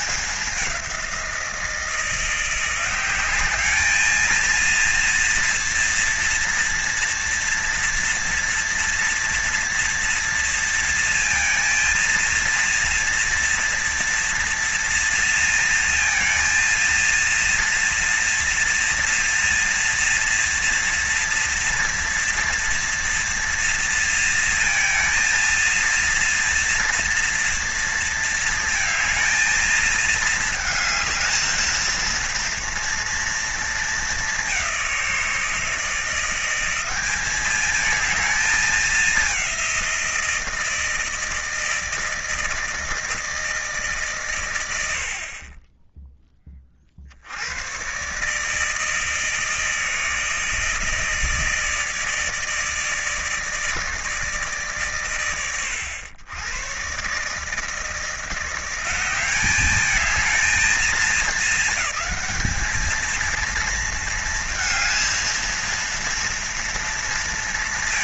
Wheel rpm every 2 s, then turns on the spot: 180, 180, 230, 230, 230, 230, 230, 230, 230, 230, 230, 230, 230, 230, 230, 220, 230, 190, 190, 220, 160, 160, 80, 40, 160, 160, 160, 140, 120, 180, 220, 220, 220, 230.
none